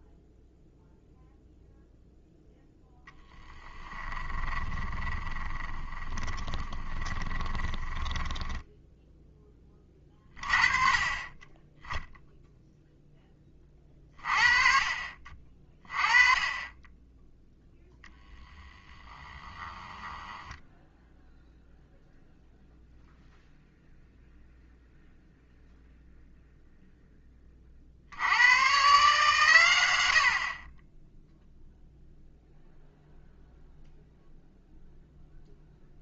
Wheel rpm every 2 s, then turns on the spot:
0, 0, 20, 20, 10, 30, 0, 40, 20, 10, 10, 0, 0, 0, 130, 30, 0, 0.
4-10